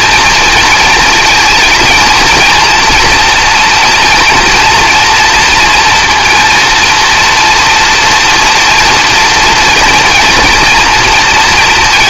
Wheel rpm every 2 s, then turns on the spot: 220, 230, 230, 230, 240, 240.
none